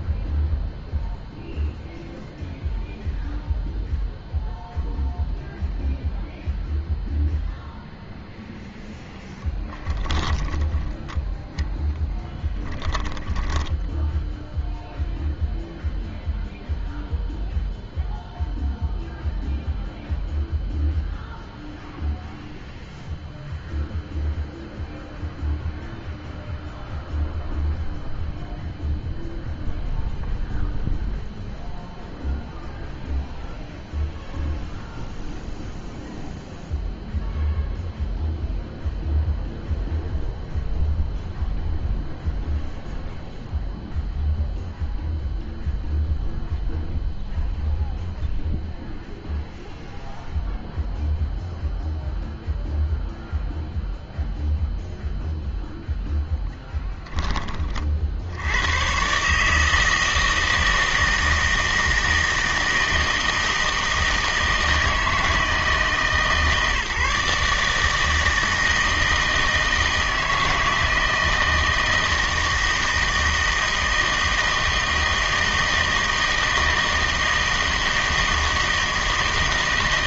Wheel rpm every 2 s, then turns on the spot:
0, 0, 0, 0, 0, 20, 10, 0, 0, 0, 0, 0, 0, 0, 0, 0, 0, 0, 0, 0, 0, 0, 0, 0, 0, 0, 0, 0, 10, 100, 160, 160, 160, 150, 160, 160, 160, 160, 160, 160.
10-14